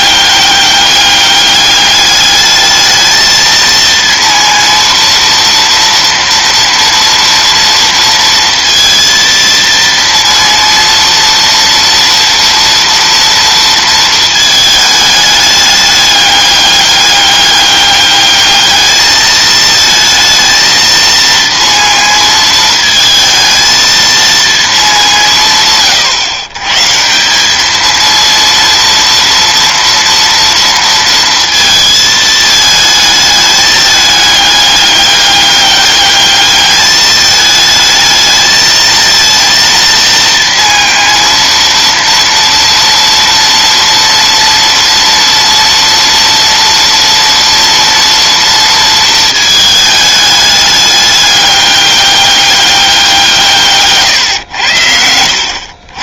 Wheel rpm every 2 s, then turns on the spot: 200, 210, 230, 230, 230, 230, 230, 220, 200, 210, 230, 220, 220, 140, 230, 230, 220, 210, 210, 220, 230, 230, 240, 230, 230, 210, 200, 90.
none